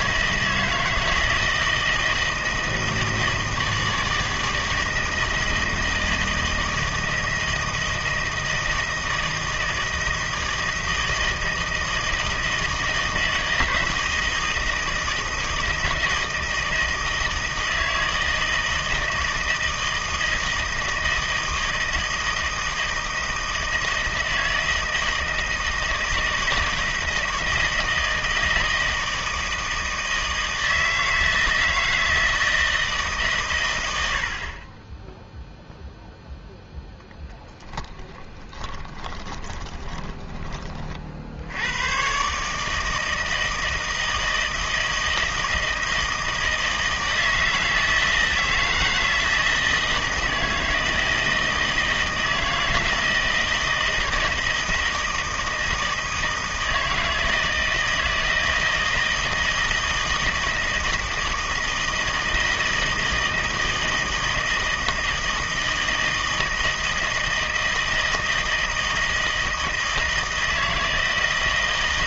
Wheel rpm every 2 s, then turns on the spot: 160, 160, 160, 160, 160, 160, 160, 160, 160, 160, 160, 160, 160, 160, 160, 160, 160, 40, 10, 30, 40, 150, 160, 160, 160, 160, 160, 160, 160, 160, 160, 160, 160, 160, 160, 160.
38-40